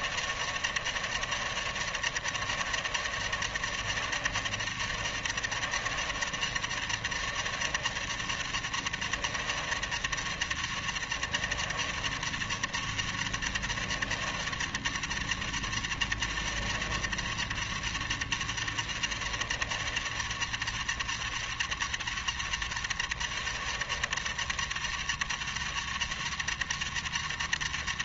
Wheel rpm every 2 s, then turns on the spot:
150, 150, 140, 140, 140, 140, 140, 140, 140, 140, 130, 130, 140, 140.
none